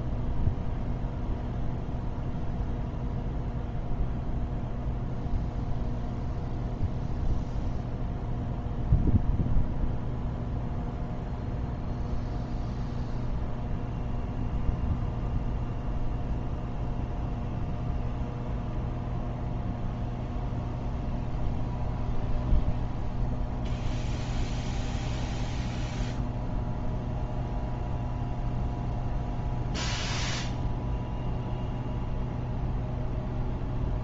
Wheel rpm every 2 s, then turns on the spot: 0, 0, 0, 0, 0, 0, 0, 0, 0, 0, 0, 0, 0, 0, 0, 0, 0.
none